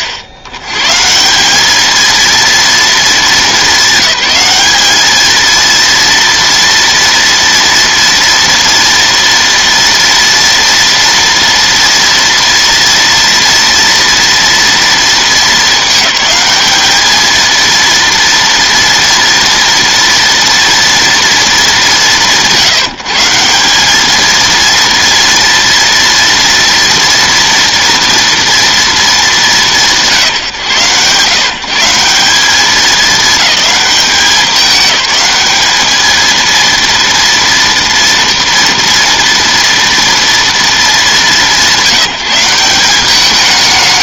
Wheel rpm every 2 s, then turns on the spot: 90, 230, 210, 230, 230, 240, 230, 230, 210, 230, 230, 150, 230, 230, 230, 150, 200, 200, 230, 230, 230, 180.
none